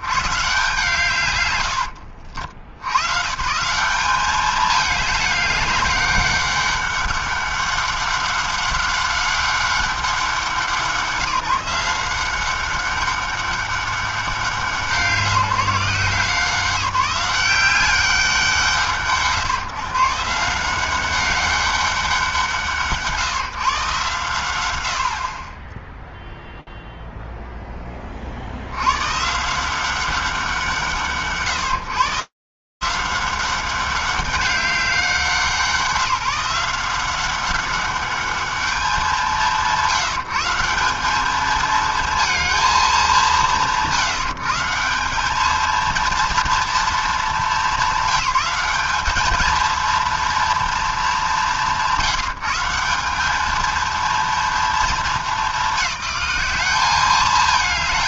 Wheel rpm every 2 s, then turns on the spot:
60, 120, 160, 210, 200, 200, 170, 200, 170, 190, 140, 200, 150, 10, 10, 170, 150, 190, 170, 200, 150, 220, 140, 230, 190, 230, 140, 230, 200.
none